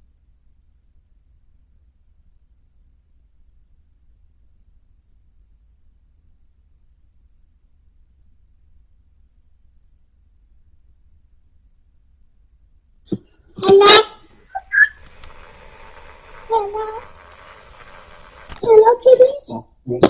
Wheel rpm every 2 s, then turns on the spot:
0, 0, 0, 0, 0, 0, 0, 10, 20, 10.
14-20